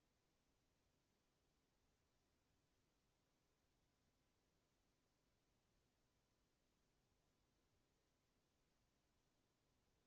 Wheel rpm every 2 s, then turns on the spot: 0, 0, 0, 0, 0.
none